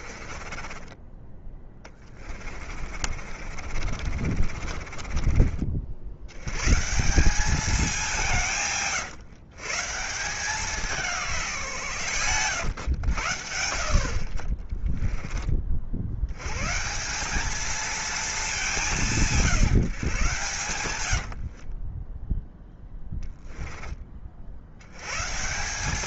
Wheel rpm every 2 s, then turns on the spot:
20, 40, 30, 160, 140, 180, 100, 20, 160, 190, 110, 0, 100.
0-6 14-16 20-22